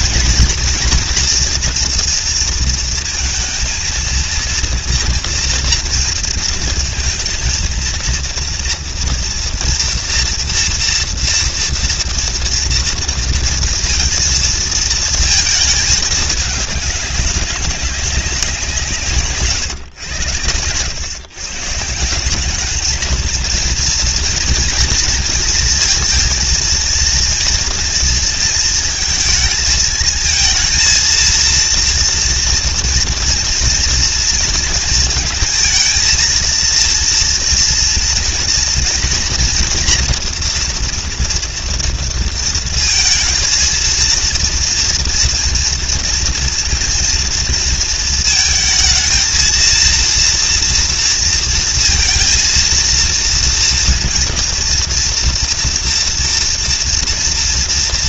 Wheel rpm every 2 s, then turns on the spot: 230, 230, 230, 230, 230, 230, 230, 220, 210, 170, 120, 220, 220, 230, 230, 230, 240, 230, 230, 230, 240, 230, 230, 230, 220, 230, 230, 230, 230.
none